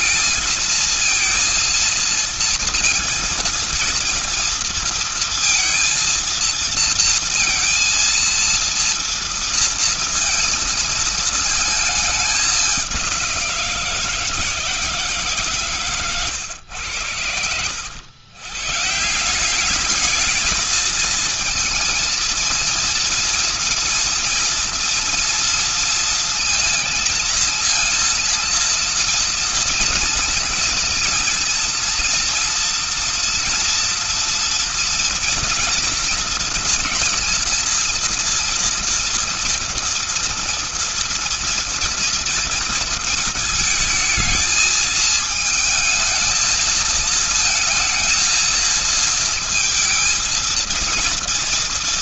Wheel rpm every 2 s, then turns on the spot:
230, 230, 230, 230, 230, 220, 190, 150, 90, 150, 220, 230, 230, 230, 230, 240, 230, 230, 230, 230, 230, 220, 220, 230, 230, 230.
none